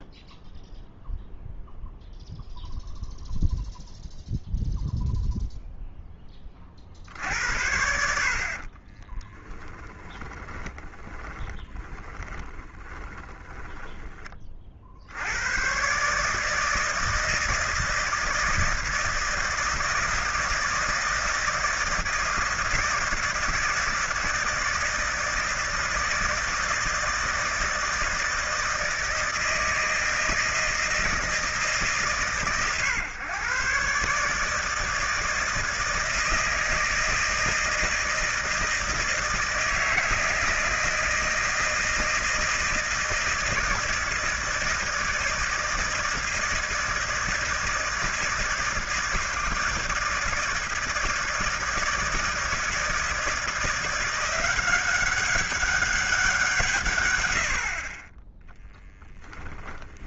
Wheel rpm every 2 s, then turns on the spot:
0, 0, 0, 30, 40, 30, 30, 40, 160, 160, 160, 160, 160, 160, 160, 160, 110, 150, 160, 160, 160, 160, 160, 160, 160, 160, 160, 190, 160, 0.
8-14